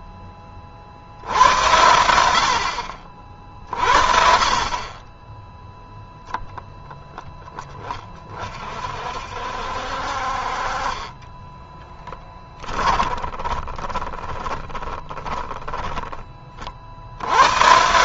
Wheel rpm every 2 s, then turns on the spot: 70, 60, 20, 0, 50, 30, 20, 10, 70.
10-16